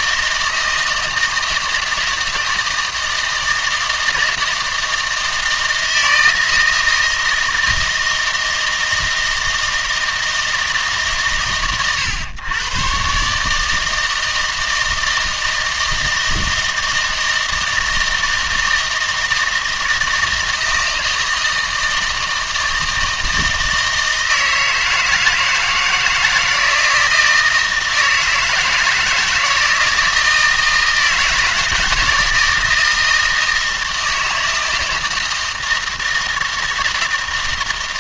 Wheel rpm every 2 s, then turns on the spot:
160, 160, 160, 160, 160, 160, 110, 160, 160, 160, 160, 160, 160, 160, 160, 160, 160, 160, 160.
none